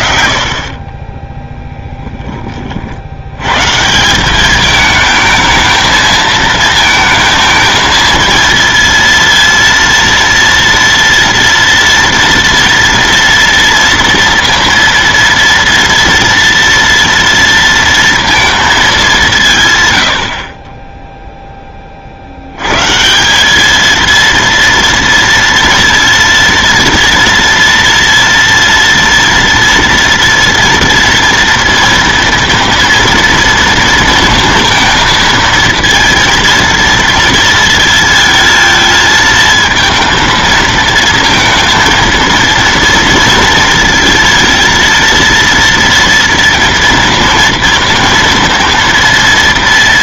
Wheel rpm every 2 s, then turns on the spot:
40, 40, 210, 220, 230, 230, 230, 230, 230, 230, 30, 120, 230, 230, 230, 230, 230, 230, 230, 230, 230, 230, 230, 230, 230.
none